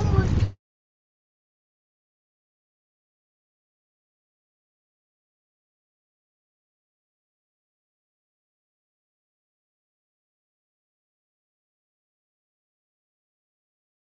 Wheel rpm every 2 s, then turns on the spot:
0, 0, 0, 0, 0, 0, 0.
none